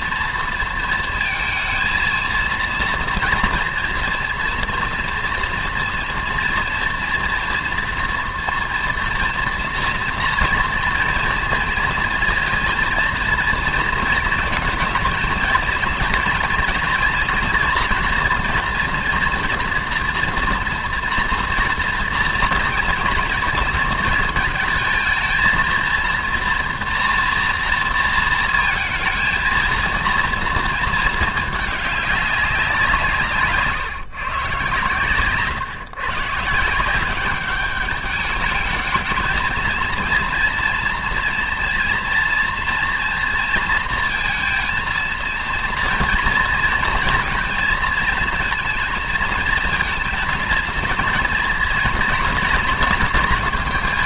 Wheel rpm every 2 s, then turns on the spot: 230, 230, 230, 240, 230, 230, 230, 230, 230, 230, 240, 230, 220, 240, 220, 220, 160, 120, 180, 220, 230, 230, 230, 230, 230, 230, 230.
none